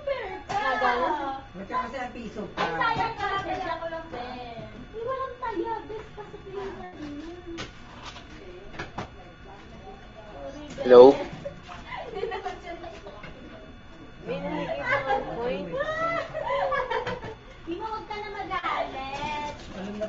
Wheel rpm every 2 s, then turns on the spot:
0, 0, 0, 0, 0, 0, 0, 0, 0, 0.
none